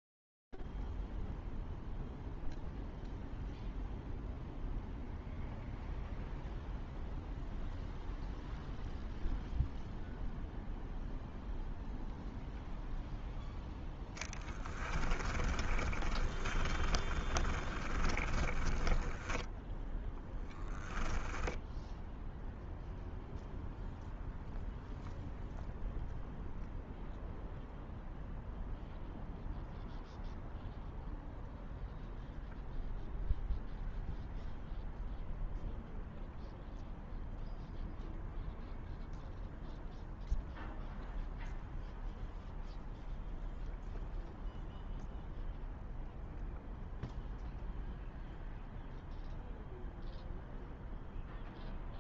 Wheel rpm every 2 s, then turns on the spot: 0, 0, 0, 0, 0, 0, 0, 10, 20, 10, 0, 0, 0, 0, 0, 0, 0, 0, 0, 0, 0, 0, 0, 0, 0, 0.
14-20